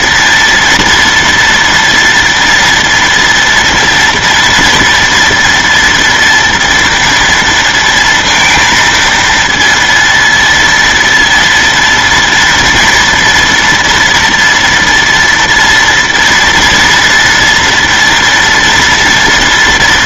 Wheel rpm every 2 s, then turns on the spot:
230, 230, 240, 230, 230, 230, 230, 240, 230, 230.
none